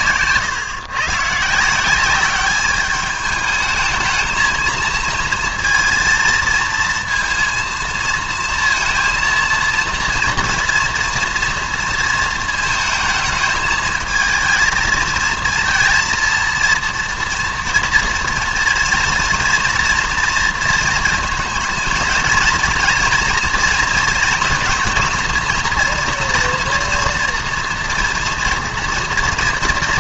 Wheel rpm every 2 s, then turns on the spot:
120, 210, 220, 230, 230, 240, 230, 220, 230, 240, 230, 230, 230, 230, 240.
none